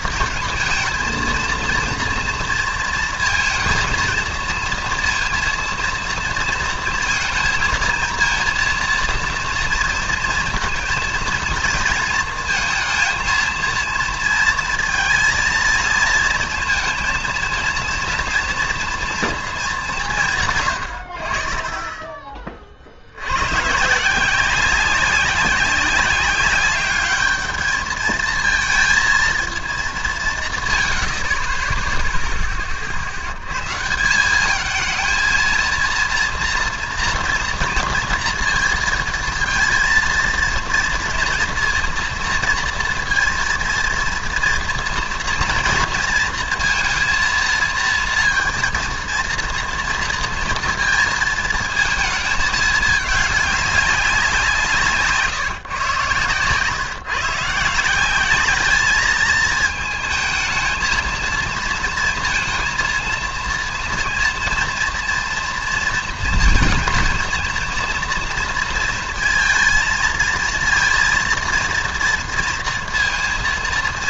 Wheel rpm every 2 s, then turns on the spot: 230, 230, 230, 230, 230, 230, 220, 230, 230, 230, 140, 40, 180, 200, 220, 160, 20, 200, 230, 230, 230, 230, 230, 230, 230, 230, 220, 180, 130, 200, 220, 230, 230, 230, 230, 230, 230.
none